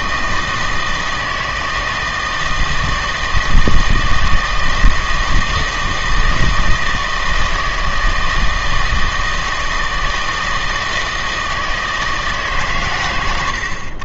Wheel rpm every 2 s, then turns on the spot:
160, 160, 160, 160, 160, 160, 140.
none